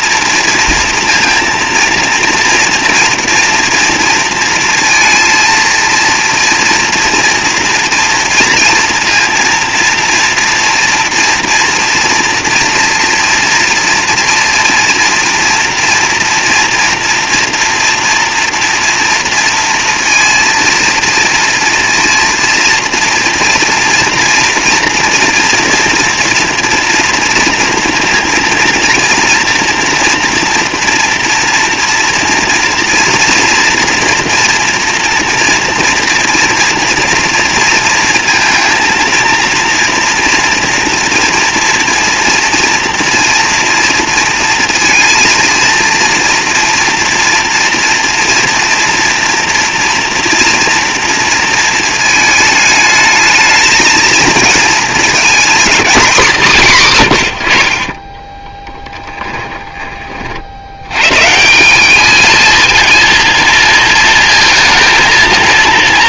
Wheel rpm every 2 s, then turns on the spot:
230, 230, 230, 230, 230, 240, 240, 230, 230, 230, 230, 230, 230, 240, 230, 230, 230, 230, 230, 230, 230, 230, 230, 230, 230, 230, 220, 220, 170, 10, 80, 230, 230.
58-60